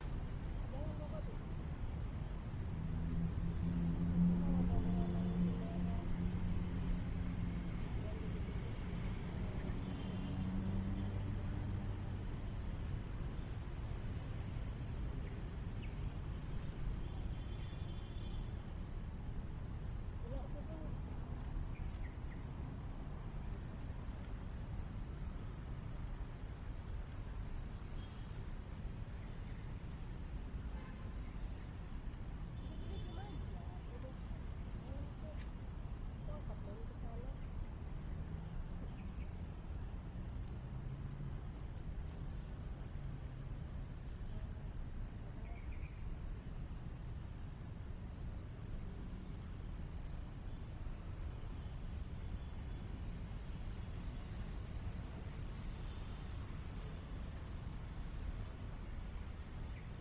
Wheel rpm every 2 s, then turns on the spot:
0, 0, 0, 0, 0, 0, 0, 0, 0, 0, 0, 0, 0, 0, 0, 0, 0, 0, 0, 0, 0, 0, 0, 0, 0, 0, 0, 0, 0, 0.
none